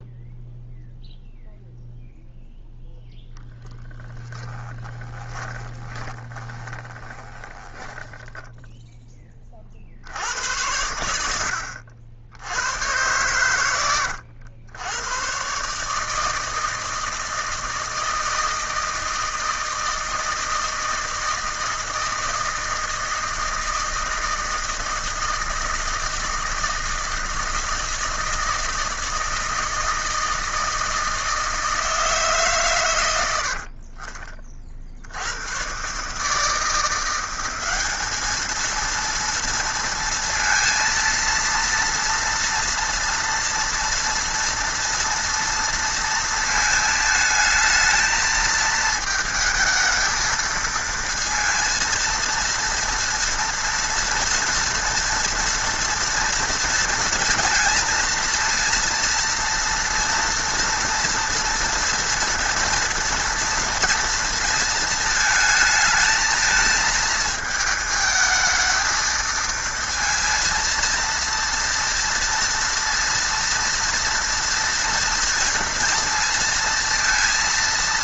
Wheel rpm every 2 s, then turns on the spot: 0, 0, 10, 20, 10, 90, 80, 90, 160, 160, 160, 160, 160, 160, 160, 160, 150, 40, 150, 210, 230, 230, 230, 220, 230, 230, 230, 230, 230, 230, 230, 230, 230, 220, 220, 230, 230, 230, 230.
4-10